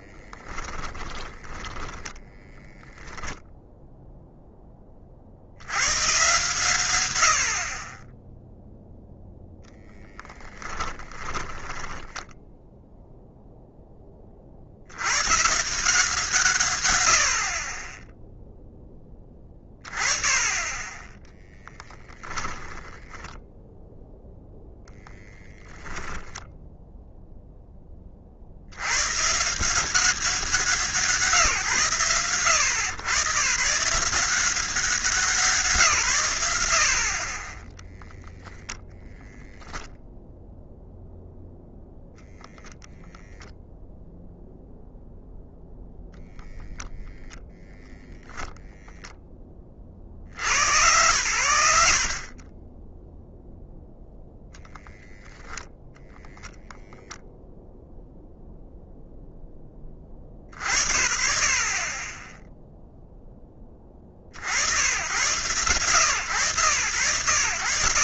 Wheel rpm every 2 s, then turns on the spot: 20, 0, 20, 110, 0, 20, 0, 80, 130, 10, 20, 0, 0, 0, 80, 180, 100, 170, 80, 0, 0, 0, 0, 0, 0, 100, 20, 0, 0, 0, 70, 0, 80, 110.
0-2 10-12